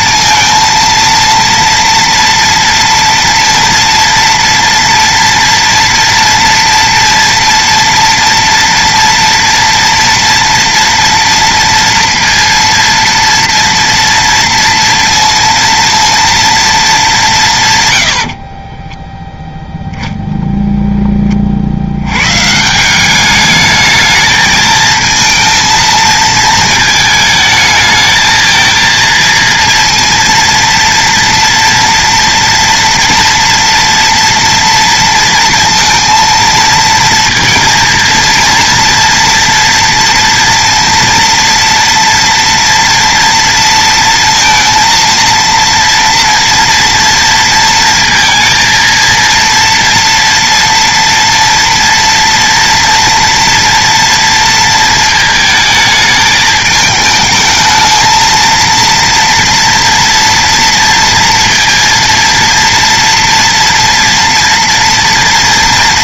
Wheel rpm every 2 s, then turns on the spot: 230, 230, 230, 230, 230, 230, 230, 230, 230, 30, 20, 160, 220, 220, 220, 230, 230, 230, 230, 230, 230, 230, 230, 230, 230, 230, 230, 230, 220, 230, 230, 230, 230.
18-20